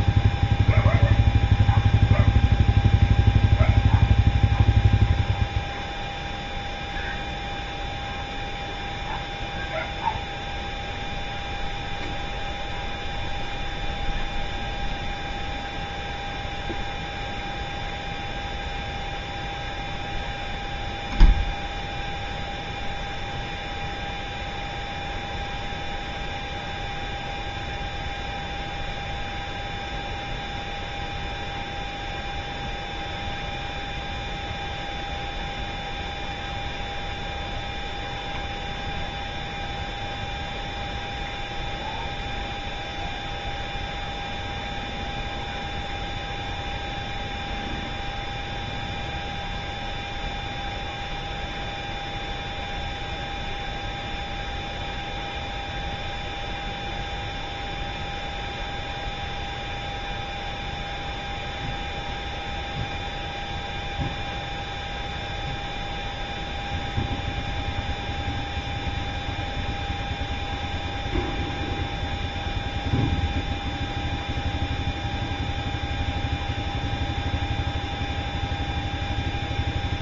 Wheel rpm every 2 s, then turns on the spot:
0, 0, 0, 0, 0, 0, 0, 0, 0, 0, 0, 0, 0, 0, 0, 0, 0, 0, 0, 0, 0, 0, 0, 0, 0, 0, 0, 0, 0, 0, 0, 0, 0, 0, 0, 0, 0, 0, 0, 0.
none